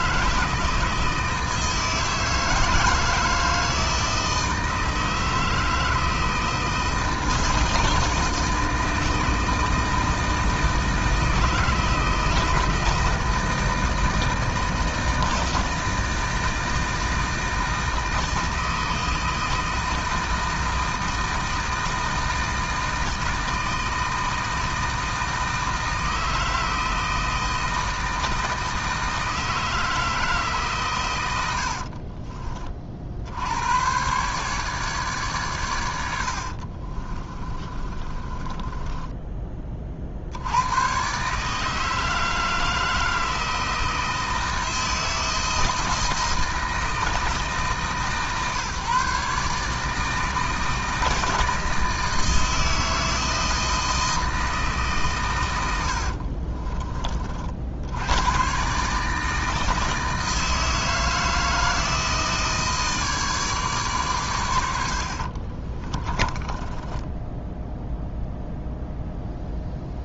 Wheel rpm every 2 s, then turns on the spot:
160, 160, 160, 160, 160, 160, 160, 160, 160, 160, 160, 160, 160, 160, 160, 130, 50, 150, 50, 20, 110, 160, 160, 160, 140, 160, 160, 150, 30, 140, 160, 160, 100, 20, 0.
36-40 56-58 64-68